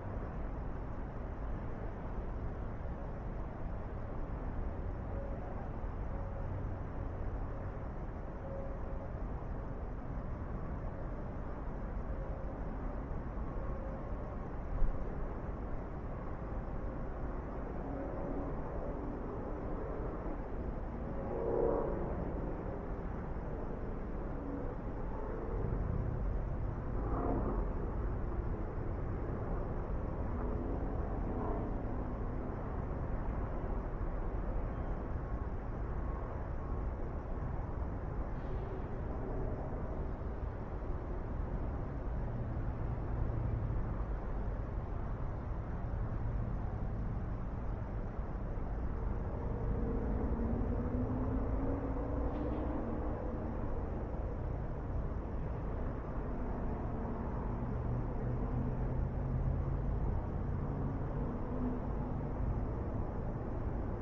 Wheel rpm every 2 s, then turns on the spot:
0, 0, 0, 0, 0, 0, 0, 0, 0, 0, 0, 0, 0, 0, 0, 0, 0, 0, 0, 0, 0, 0, 0, 0, 0, 0, 0, 0, 0, 0, 0, 0.
none